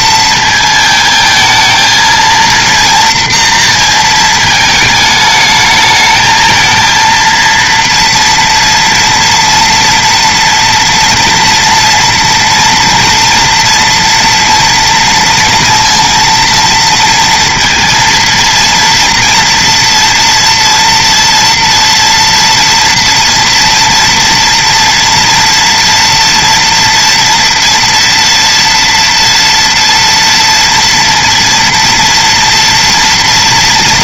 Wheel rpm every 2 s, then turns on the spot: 220, 230, 220, 230, 230, 240, 240, 230, 230, 230, 230, 240, 230, 230, 230, 230, 230.
none